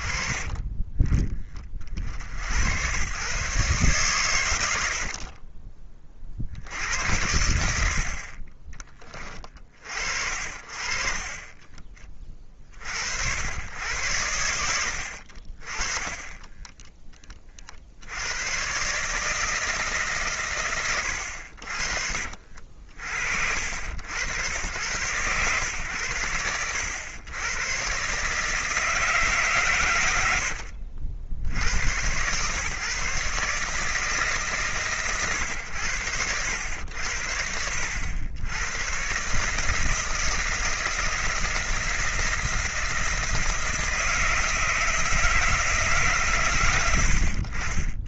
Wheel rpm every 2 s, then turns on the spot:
30, 90, 100, 70, 30, 50, 40, 80, 10, 110, 120, 50, 100, 90, 160, 70, 120, 140, 90, 110, 160, 170, 160, 110.
30-32